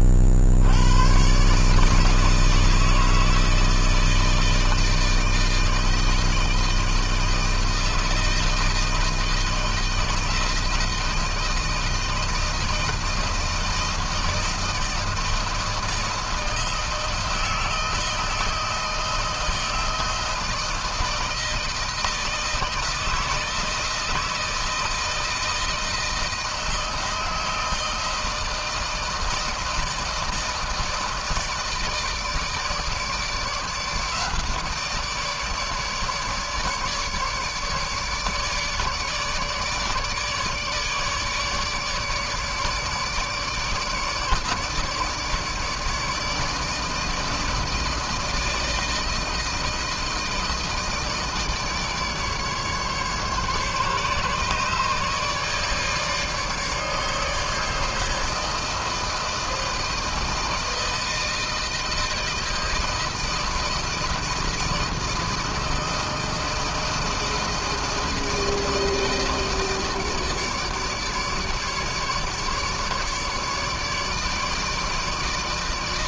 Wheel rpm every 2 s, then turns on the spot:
80, 160, 160, 160, 160, 160, 160, 160, 160, 160, 160, 160, 160, 160, 160, 160, 150, 160, 150, 150, 150, 150, 150, 160, 160, 160, 150, 150, 150, 160, 160, 160, 160, 160, 160, 150, 150, 150.
none